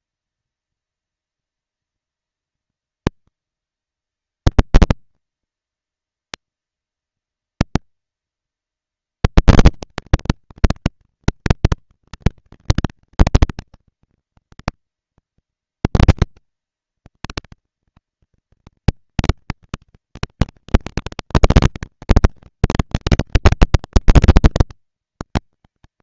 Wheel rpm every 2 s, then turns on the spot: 230, 230, 220, 230, 230, 230, 240, 240, 230, 230, 230, 220, 230.
none